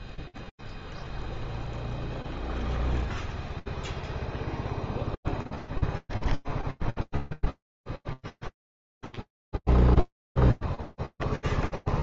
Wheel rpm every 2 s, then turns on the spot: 0, 0, 0, 0, 0, 0.
none